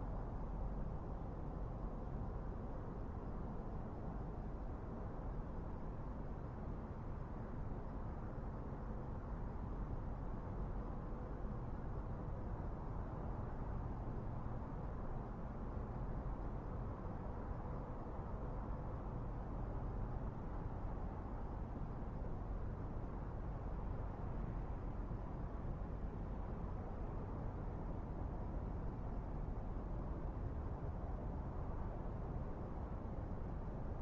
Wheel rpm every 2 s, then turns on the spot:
0, 0, 0, 0, 0, 0, 0, 0, 0, 0, 0, 0, 0, 0, 0, 0, 0.
none